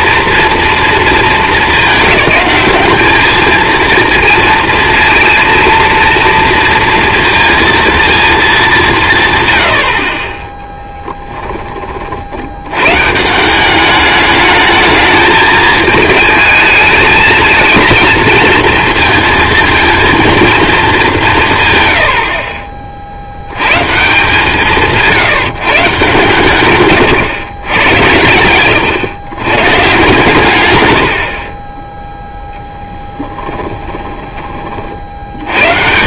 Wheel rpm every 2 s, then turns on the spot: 220, 210, 230, 230, 150, 10, 120, 220, 220, 230, 210, 30, 170, 130, 110, 100, 10, 40.
10-12 28-30 32-34